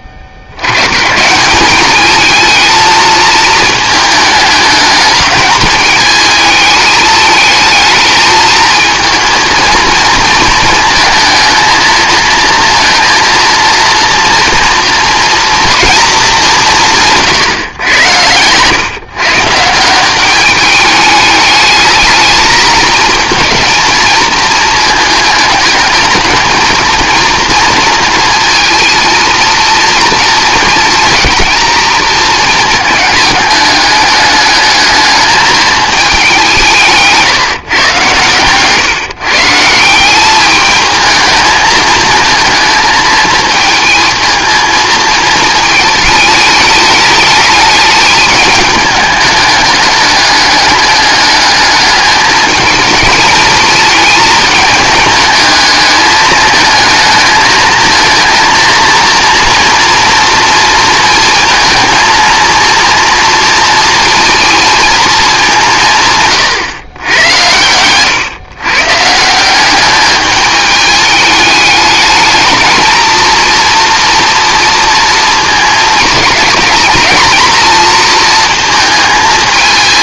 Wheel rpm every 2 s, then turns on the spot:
70, 220, 210, 220, 220, 230, 230, 230, 180, 120, 200, 220, 220, 220, 230, 230, 220, 210, 170, 140, 210, 220, 220, 210, 220, 210, 220, 210, 220, 230, 230, 230, 230, 120, 130, 210, 220, 230, 220, 230.
none